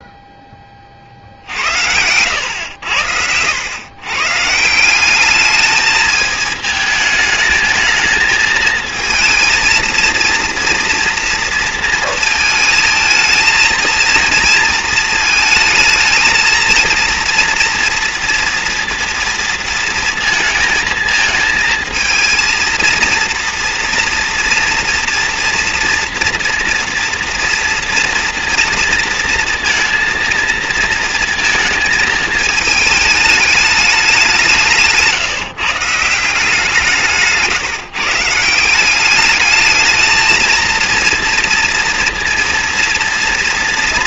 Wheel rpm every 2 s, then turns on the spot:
30, 100, 160, 220, 220, 230, 230, 230, 230, 230, 230, 230, 230, 230, 230, 230, 210, 170, 170, 180, 230, 230.
none